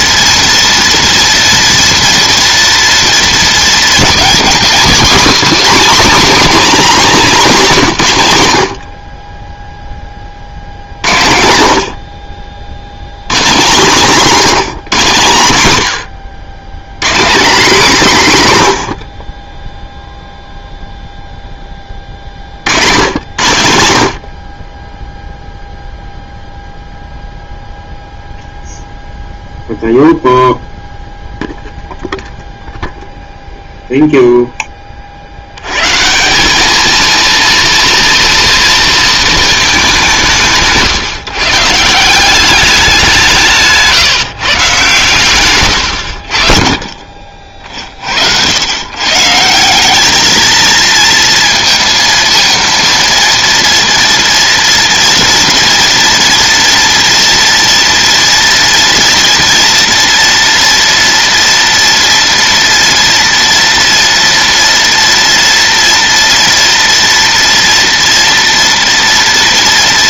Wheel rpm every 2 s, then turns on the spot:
230, 230, 250, 270, 40, 90, 110, 170, 180, 80, 0, 100, 0, 0, 0, 0, 0, 40, 230, 230, 160, 180, 140, 40, 130, 230, 230, 230, 230, 230, 230, 240, 230, 230, 240.
none